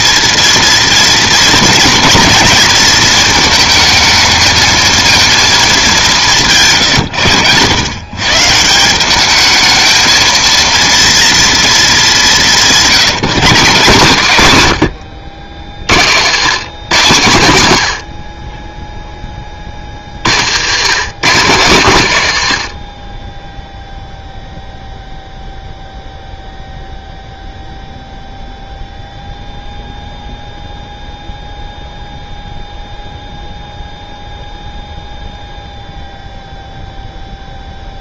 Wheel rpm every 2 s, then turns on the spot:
230, 230, 220, 160, 150, 230, 180, 140, 140, 30, 110, 110, 0, 0, 0, 0, 0, 0, 0.
none